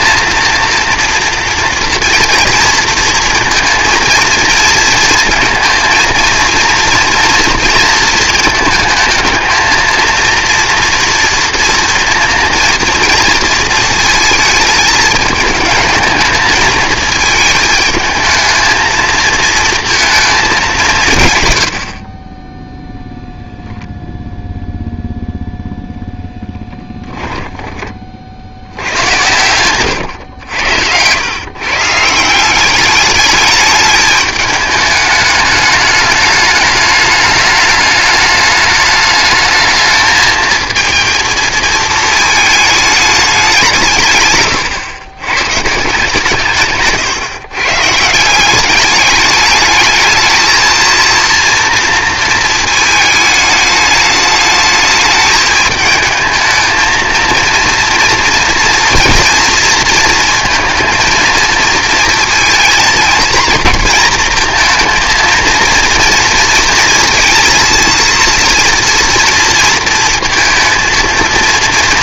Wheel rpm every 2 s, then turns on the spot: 230, 230, 230, 230, 220, 230, 230, 220, 220, 220, 200, 10, 0, 10, 80, 100, 180, 210, 210, 220, 230, 210, 120, 140, 190, 220, 220, 210, 220, 230, 230, 230, 230, 230, 240, 230.
22-24 26-28 30-32 46-48